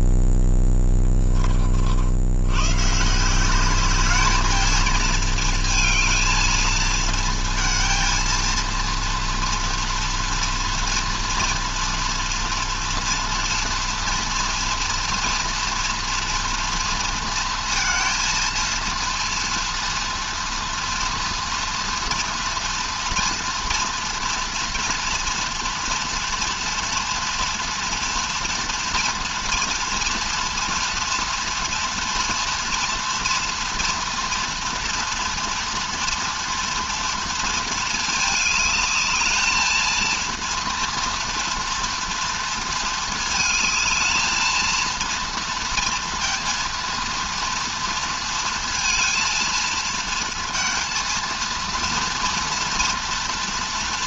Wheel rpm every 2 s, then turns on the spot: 10, 120, 220, 220, 230, 230, 230, 240, 230, 230, 230, 230, 230, 240, 230, 230, 230, 230, 240, 210, 230, 230, 230, 230, 230, 230, 230.
none